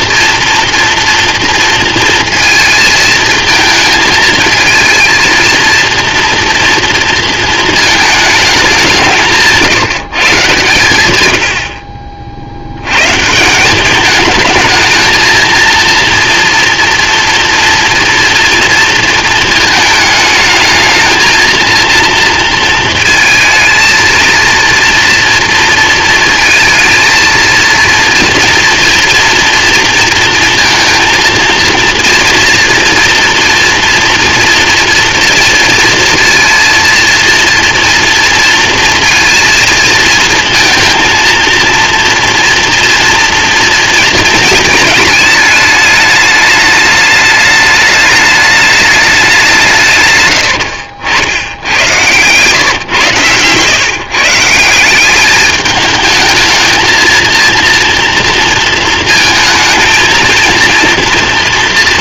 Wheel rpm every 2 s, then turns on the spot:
230, 230, 230, 230, 190, 120, 90, 220, 240, 230, 220, 230, 230, 220, 230, 230, 230, 230, 230, 230, 220, 230, 220, 210, 210, 90, 130, 180, 220, 230, 230.
50-54